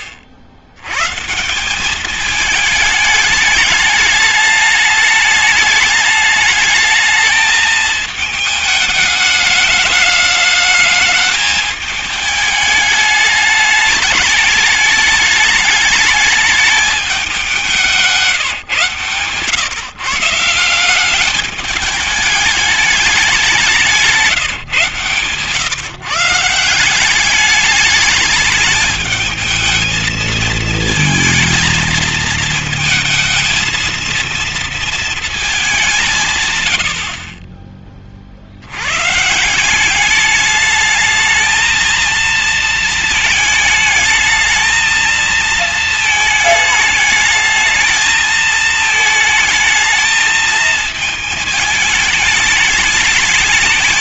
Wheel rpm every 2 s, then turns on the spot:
70, 220, 210, 210, 210, 210, 210, 210, 210, 160, 170, 210, 140, 160, 210, 230, 220, 230, 130, 60, 210, 220, 220, 220, 220, 220, 210.
none